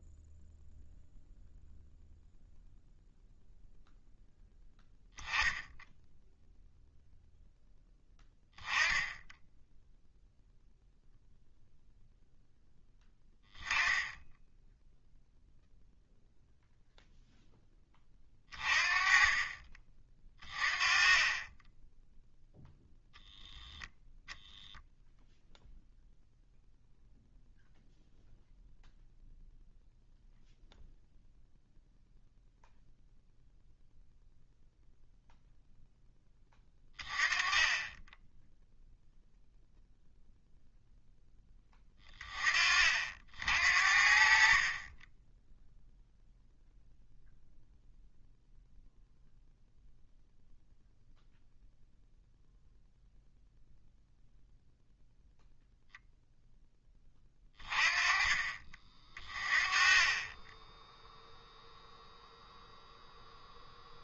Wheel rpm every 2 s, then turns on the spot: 0, 0, 0, 0, 10, 0, 0, 0, 0, 30, 30, 0, 0, 0, 0, 0, 0, 0, 20, 0, 0, 50, 30, 0, 0, 0, 0, 0, 10, 40, 10, 0.
none